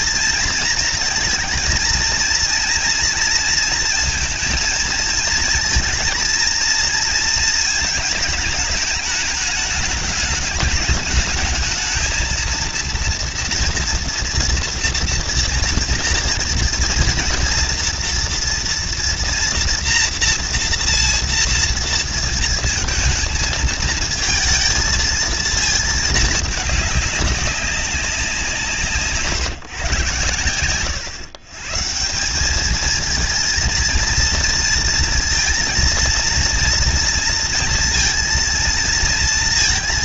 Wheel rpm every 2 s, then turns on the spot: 220, 230, 230, 230, 220, 210, 220, 230, 230, 230, 240, 230, 220, 210, 180, 120, 180, 230, 230, 230.
none